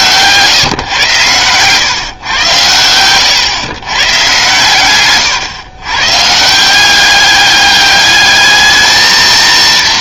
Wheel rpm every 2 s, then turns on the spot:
140, 120, 130, 150, 210.
none